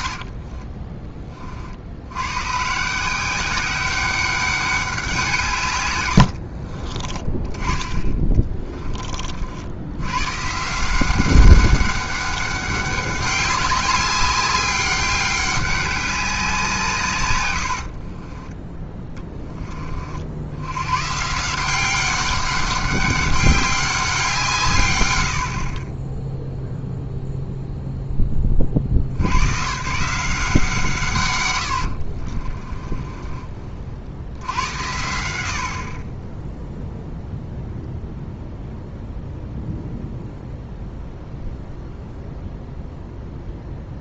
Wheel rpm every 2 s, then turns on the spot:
30, 130, 200, 70, 30, 150, 200, 200, 170, 20, 90, 200, 140, 0, 30, 170, 30, 90, 10, 0, 0, 0.
0-2 6-10 32-34